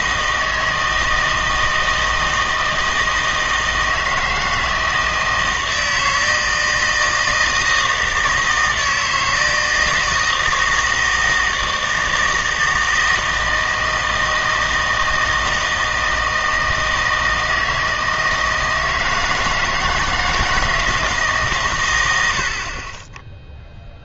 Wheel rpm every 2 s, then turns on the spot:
160, 160, 160, 160, 160, 160, 160, 160, 160, 160, 160, 40.
none